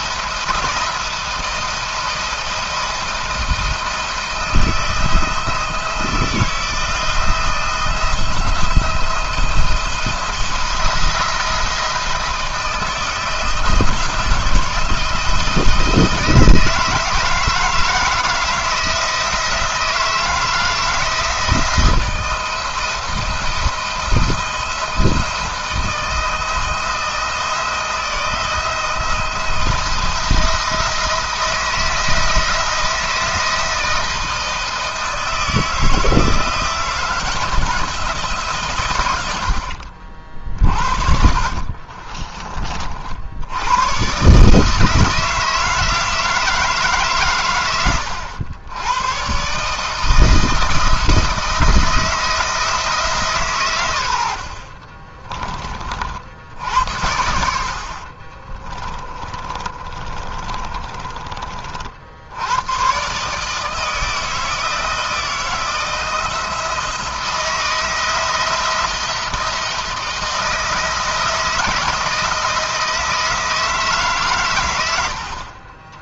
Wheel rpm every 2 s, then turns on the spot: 170, 170, 170, 160, 170, 170, 160, 170, 160, 160, 160, 170, 170, 170, 160, 170, 160, 160, 170, 140, 50, 40, 150, 150, 100, 170, 160, 40, 80, 30, 40, 110, 160, 160, 170, 170, 160, 110.
54-56 58-62 74-76